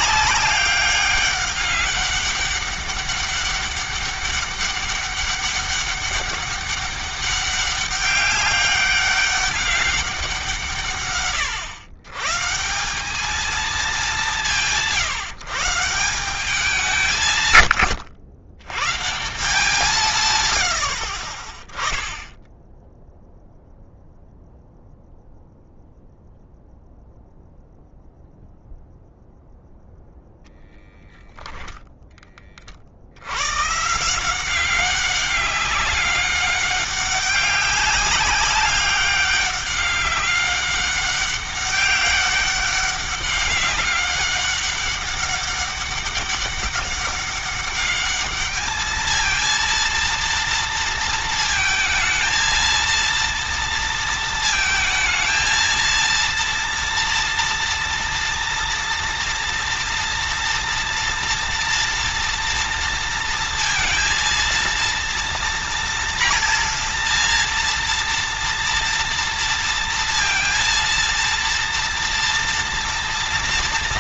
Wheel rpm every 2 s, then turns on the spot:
200, 200, 200, 200, 200, 130, 180, 150, 180, 130, 100, 10, 0, 0, 0, 0, 50, 190, 200, 200, 200, 200, 200, 200, 220, 230, 230, 230, 230, 230, 230, 230, 230, 230, 230, 230, 230.
none